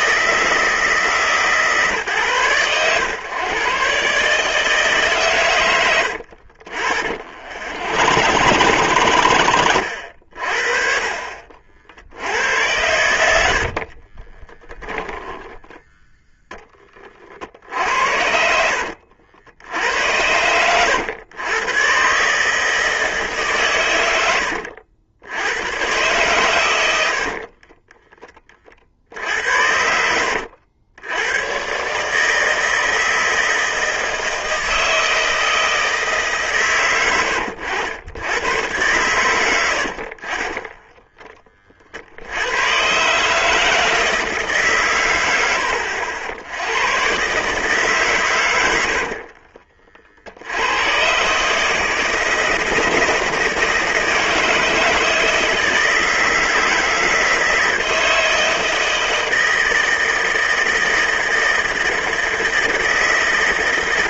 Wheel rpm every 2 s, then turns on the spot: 150, 100, 150, 50, 100, 50, 80, 10, 20, 70, 100, 150, 80, 100, 40, 80, 160, 160, 120, 100, 10, 110, 130, 100, 90, 90, 160, 160, 160, 160, 160, 160.
6-10 14-16 18-20 40-42